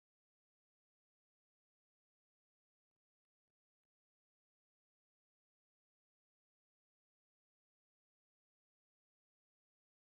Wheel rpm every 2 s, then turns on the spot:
0, 0, 0, 0, 0.
none